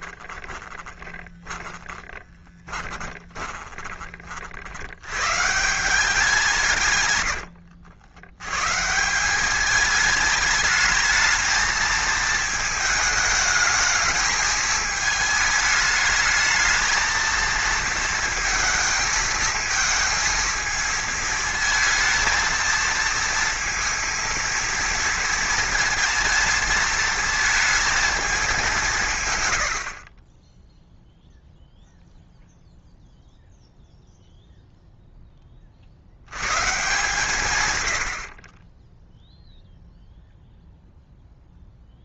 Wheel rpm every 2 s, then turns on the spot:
20, 20, 80, 160, 140, 220, 220, 220, 220, 220, 220, 230, 230, 230, 190, 10, 0, 0, 140, 20, 0.
0-4